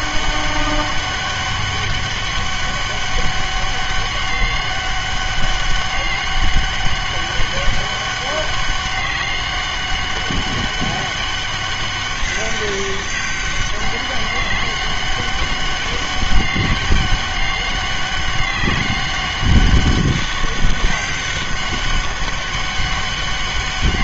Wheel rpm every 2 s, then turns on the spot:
200, 200, 200, 200, 200, 200, 200, 200, 200, 200, 190, 190.
none